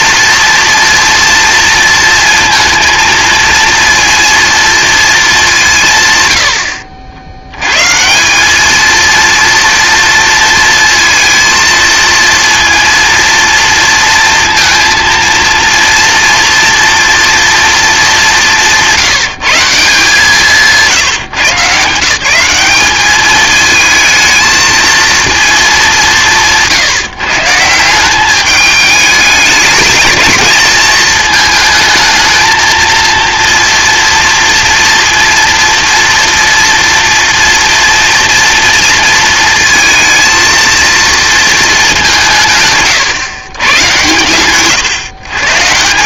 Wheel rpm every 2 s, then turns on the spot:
230, 230, 230, 80, 210, 230, 230, 230, 230, 190, 160, 200, 230, 160, 210, 220, 230, 230, 230, 230, 230, 150, 120.
none